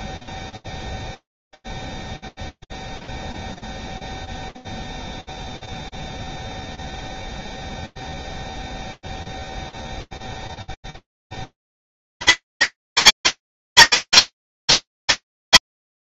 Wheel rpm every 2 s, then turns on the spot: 0, 0, 0, 0, 0, 0, 0, 0.
none